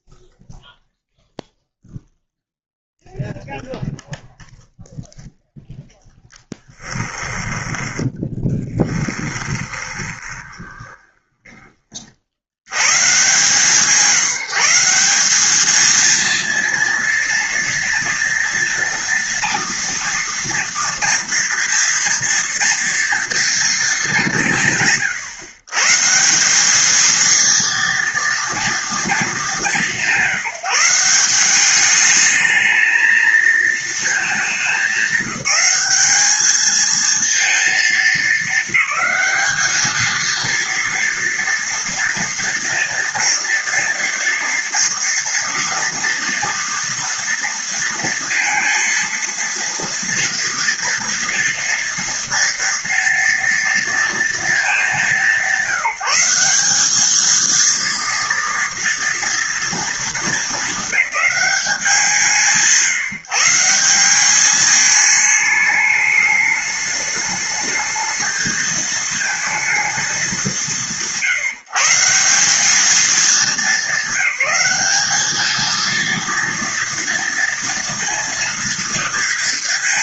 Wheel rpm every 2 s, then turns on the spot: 0, 0, 0, 0, 20, 20, 70, 170, 230, 230, 230, 230, 190, 170, 230, 180, 220, 220, 210, 220, 230, 230, 230, 230, 230, 230, 230, 220, 190, 230, 210, 160, 210, 210, 220, 180, 190, 190, 230, 230.
8-12